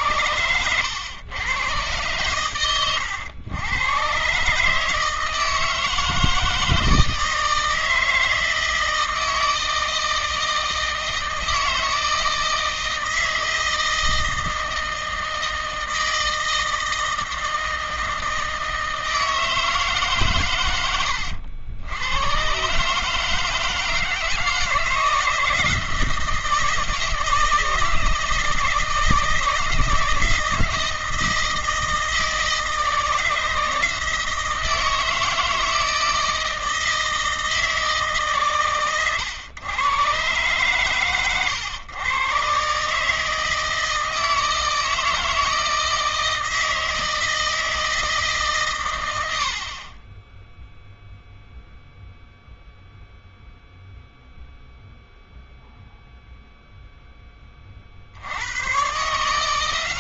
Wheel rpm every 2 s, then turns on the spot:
110, 110, 150, 160, 160, 160, 160, 160, 160, 160, 90, 140, 160, 160, 160, 160, 160, 160, 160, 120, 130, 140, 160, 160, 110, 0, 0, 0, 0, 130.
none